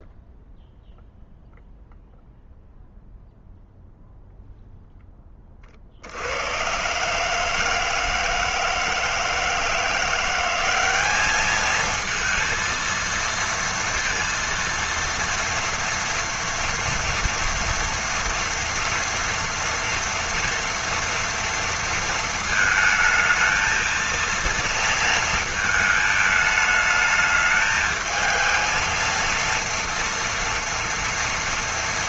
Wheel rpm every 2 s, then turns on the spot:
0, 0, 0, 110, 160, 190, 230, 230, 230, 230, 230, 220, 230, 210, 220, 230.
none